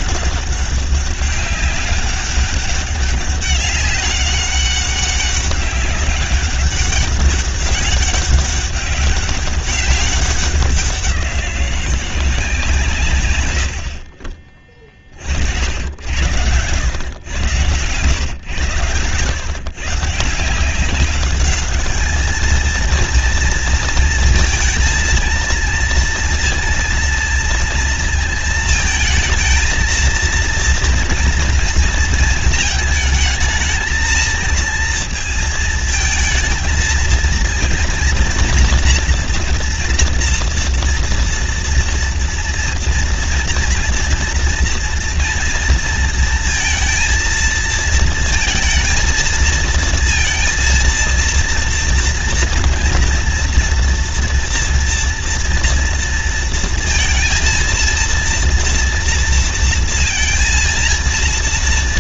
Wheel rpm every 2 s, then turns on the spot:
200, 200, 200, 200, 200, 190, 160, 30, 110, 110, 190, 230, 220, 230, 220, 230, 220, 230, 230, 240, 230, 230, 230, 230, 220, 230, 230, 230, 230, 230, 230.
none